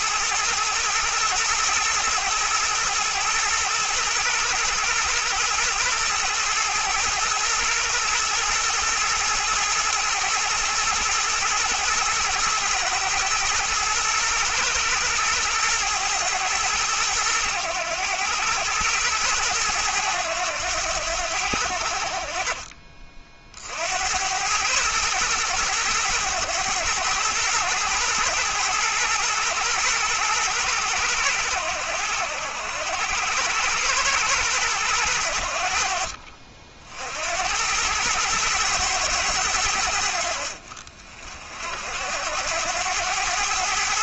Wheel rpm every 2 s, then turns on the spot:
110, 120, 120, 110, 110, 120, 110, 110, 110, 100, 90, 40, 110, 110, 110, 110, 90, 110, 60, 110, 60, 90.
none